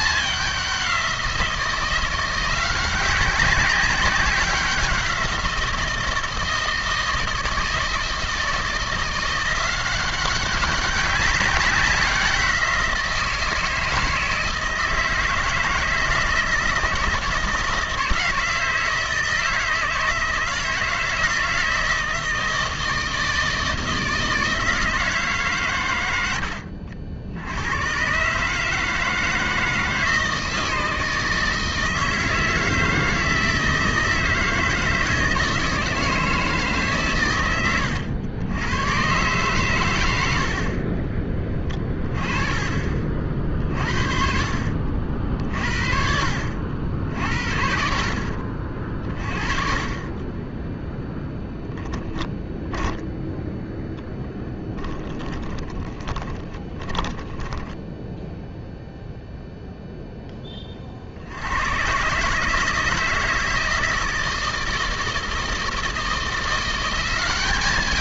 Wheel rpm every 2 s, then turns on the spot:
200, 180, 190, 160, 170, 190, 180, 160, 160, 160, 160, 160, 160, 90, 150, 160, 160, 160, 150, 100, 60, 30, 60, 70, 50, 10, 10, 20, 20, 0, 20, 150, 160, 180.
50-58